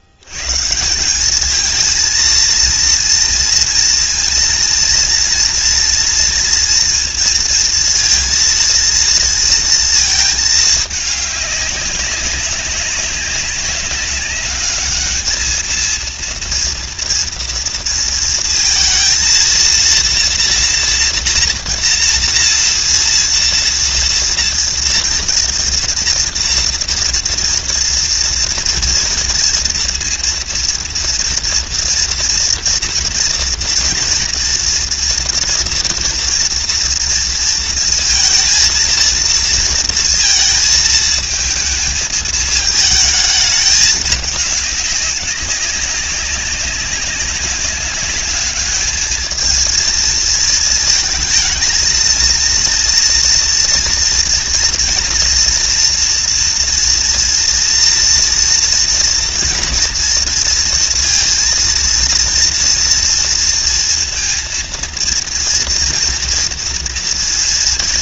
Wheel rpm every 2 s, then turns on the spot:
70, 230, 230, 240, 230, 220, 200, 200, 230, 230, 230, 230, 230, 240, 240, 240, 230, 230, 230, 230, 230, 220, 210, 200, 210, 230, 230, 230, 230, 230, 230, 230, 230, 230.
none